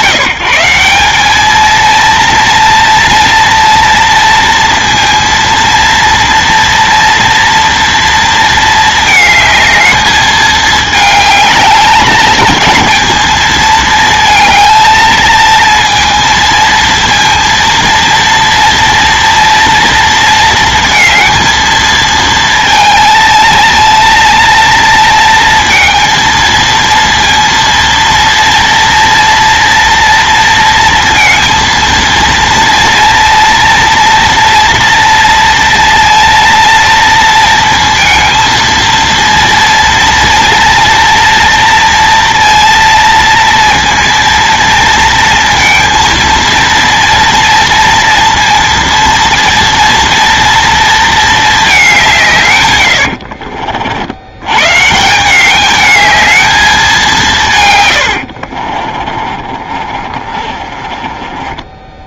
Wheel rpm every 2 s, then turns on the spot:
160, 230, 230, 230, 220, 210, 220, 220, 230, 230, 230, 220, 230, 230, 230, 230, 230, 230, 230, 230, 230, 230, 230, 230, 230, 230, 130, 110, 210, 60, 30.
58-62